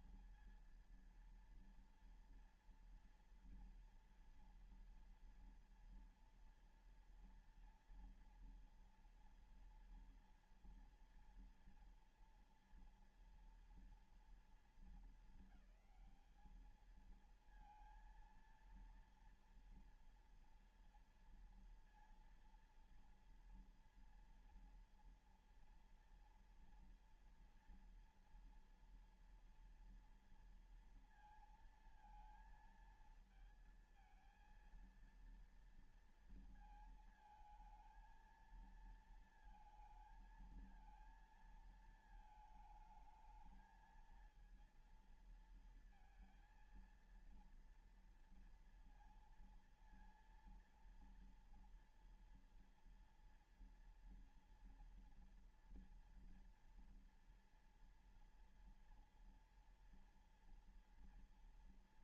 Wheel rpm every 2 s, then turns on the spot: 230, 230, 230, 230, 230, 230, 230, 230, 210, 230, 230, 230, 230, 240, 230, 230, 230, 230, 230, 230, 230, 230, 230, 230, 230, 230, 230, 230, 240, 230, 230.
none